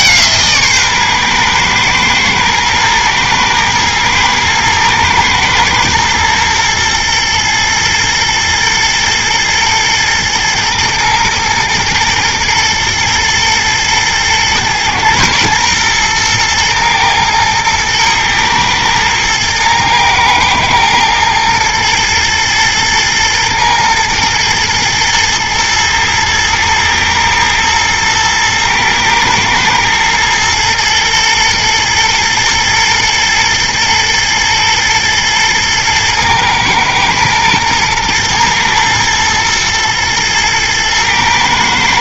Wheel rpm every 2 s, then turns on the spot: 140, 110, 120, 120, 110, 110, 110, 120, 110, 110, 110, 120, 110, 110, 110, 110, 110, 110, 110, 110, 110.
none